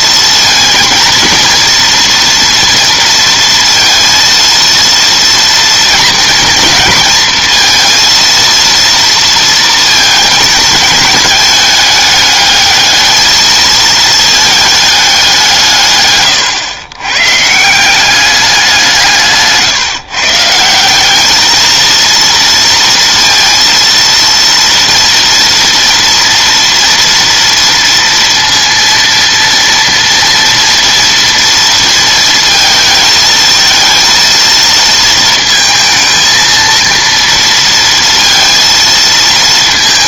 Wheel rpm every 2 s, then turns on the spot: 230, 230, 230, 230, 230, 220, 210, 210, 120, 190, 170, 230, 230, 230, 230, 230, 220, 230, 230, 220.
none